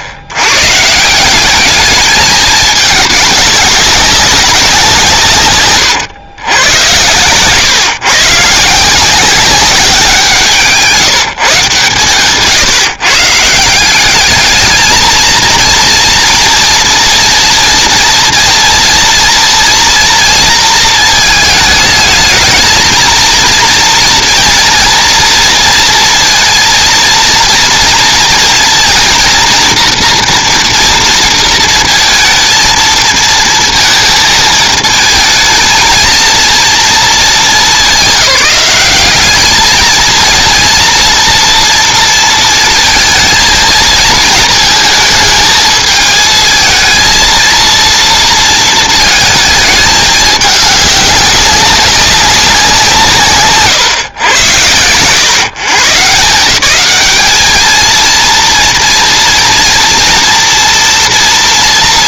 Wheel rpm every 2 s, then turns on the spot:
90, 220, 190, 110, 160, 160, 140, 210, 230, 230, 230, 220, 230, 230, 230, 230, 230, 220, 230, 200, 230, 230, 220, 230, 230, 200, 190, 110, 180, 230, 230.
none